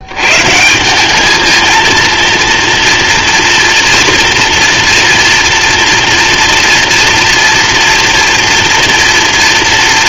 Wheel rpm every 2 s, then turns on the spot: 210, 230, 240, 240, 230.
none